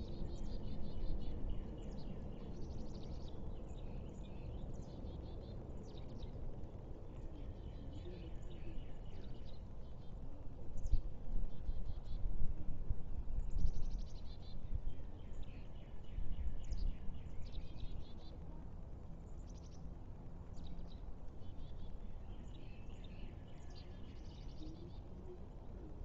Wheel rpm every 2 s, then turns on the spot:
0, 0, 0, 0, 0, 0, 0, 0, 0, 0, 0, 0, 0.
none